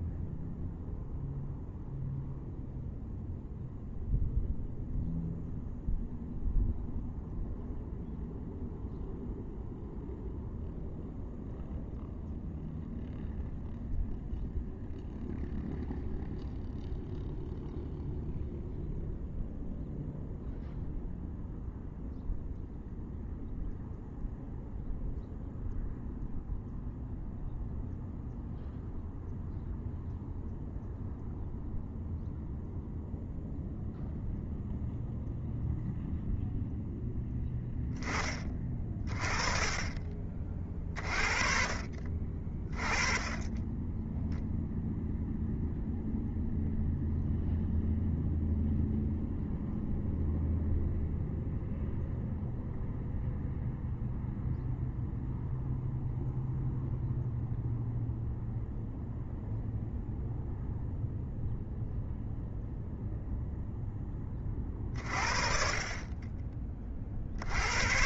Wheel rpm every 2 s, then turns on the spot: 0, 0, 0, 0, 0, 0, 0, 0, 0, 0, 0, 0, 0, 0, 0, 0, 0, 0, 0, 20, 30, 30, 0, 0, 0, 0, 0, 0, 0, 0, 0, 0, 40, 30.
none